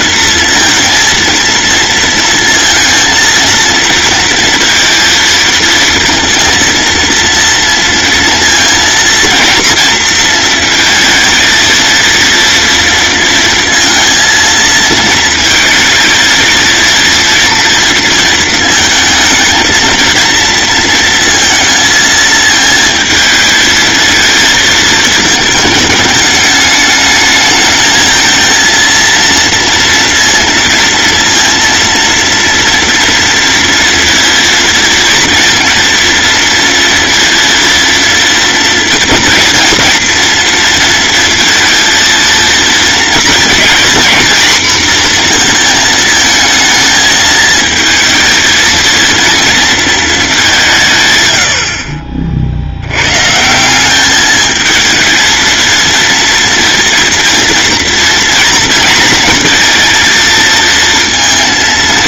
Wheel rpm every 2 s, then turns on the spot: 230, 230, 230, 230, 230, 230, 230, 230, 230, 230, 230, 220, 220, 210, 230, 230, 230, 230, 230, 220, 230, 230, 240, 220, 220, 160, 90, 220, 230, 240, 230.
none